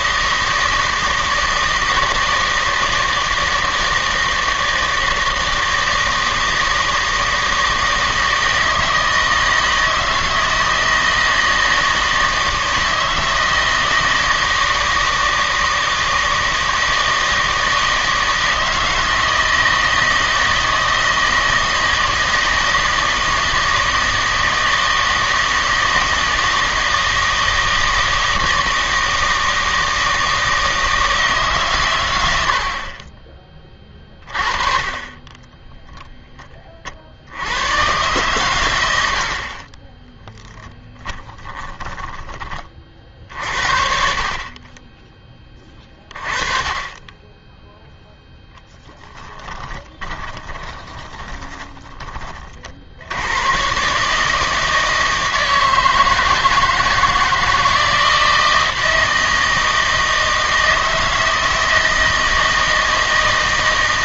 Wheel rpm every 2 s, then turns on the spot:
160, 160, 160, 160, 160, 160, 160, 160, 160, 160, 160, 160, 160, 160, 160, 160, 70, 30, 40, 90, 10, 30, 20, 20, 10, 20, 60, 160, 160, 160, 160, 160.
38-42 48-52